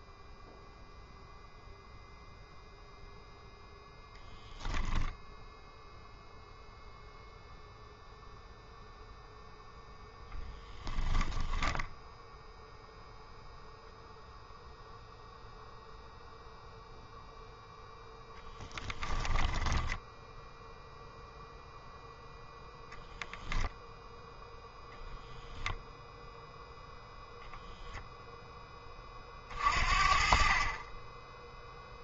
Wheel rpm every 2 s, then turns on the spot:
0, 0, 0, 0, 0, 10, 0, 0, 0, 10, 0, 10, 0, 0, 20, 20.
10-12 18-20